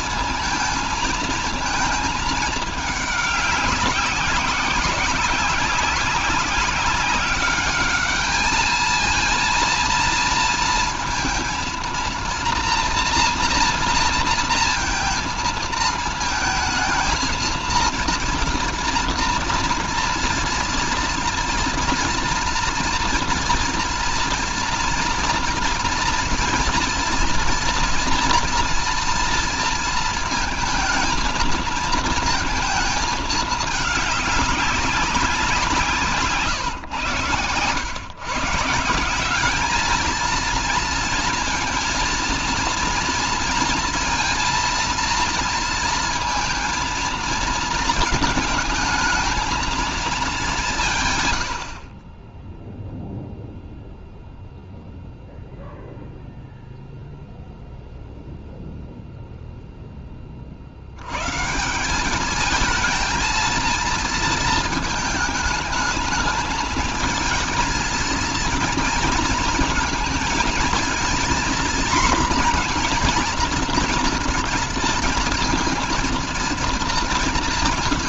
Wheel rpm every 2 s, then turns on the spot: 230, 210, 190, 190, 220, 230, 240, 230, 220, 230, 230, 230, 230, 230, 230, 230, 220, 200, 130, 160, 230, 230, 230, 230, 220, 180, 0, 0, 0, 0, 60, 220, 220, 220, 230, 220, 240, 230, 230.
none